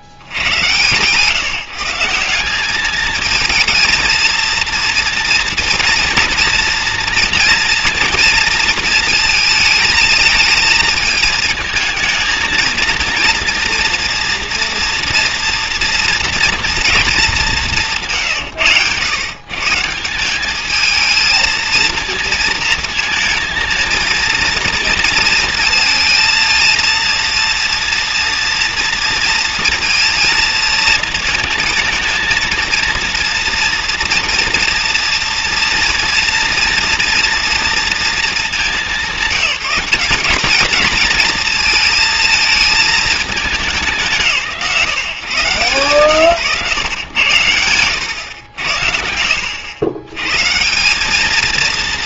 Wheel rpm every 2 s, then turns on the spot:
60, 190, 230, 230, 230, 220, 230, 230, 240, 140, 200, 230, 230, 230, 230, 230, 230, 230, 230, 210, 210, 220, 150, 110, 110, 130.
none